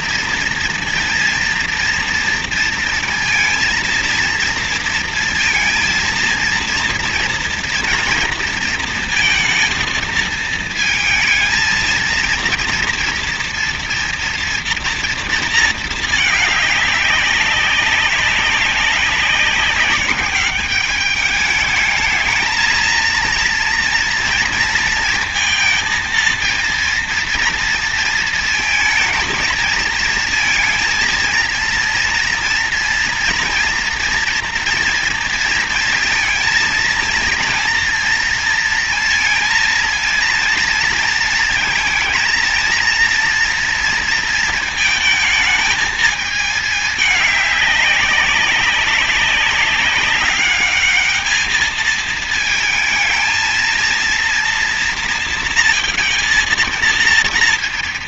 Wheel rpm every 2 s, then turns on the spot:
230, 230, 230, 230, 230, 230, 230, 230, 200, 190, 200, 230, 230, 230, 220, 230, 230, 230, 230, 230, 230, 230, 220, 220, 200, 210, 220, 230, 230.
none